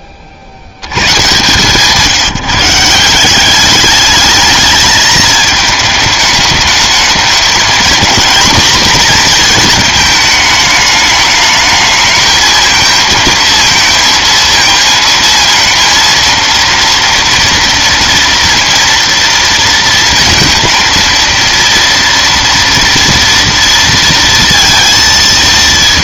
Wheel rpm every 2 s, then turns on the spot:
100, 170, 220, 210, 240, 210, 230, 230, 230, 230, 230, 230, 230.
none